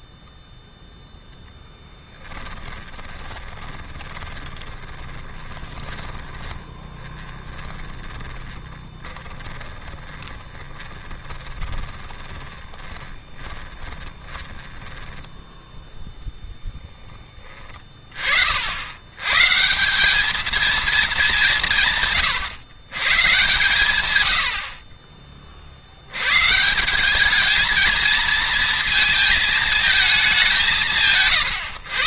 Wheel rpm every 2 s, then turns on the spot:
0, 20, 20, 30, 20, 20, 20, 10, 10, 80, 220, 130, 50, 180, 220, 170.
2-14